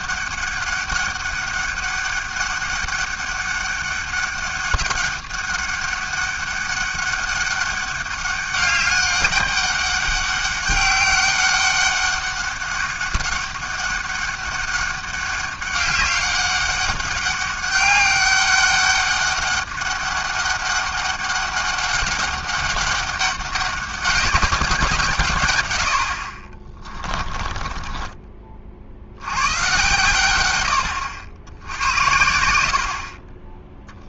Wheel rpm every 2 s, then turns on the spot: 200, 200, 200, 200, 200, 200, 200, 200, 200, 200, 200, 200, 200, 40, 40, 100, 70.
26-28